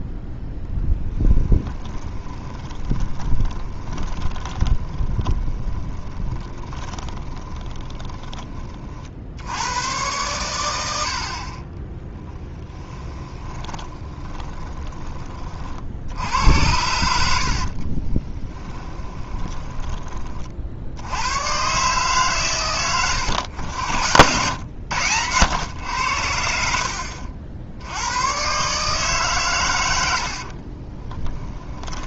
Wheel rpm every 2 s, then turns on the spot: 0, 20, 20, 20, 40, 90, 10, 20, 90, 20, 60, 100, 100, 60, 130, 40.
2-8 12-16 18-20 30-32